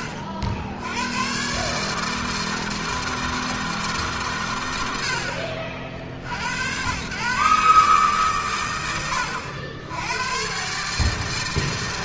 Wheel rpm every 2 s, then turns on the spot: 100, 160, 80, 110, 70, 140.
none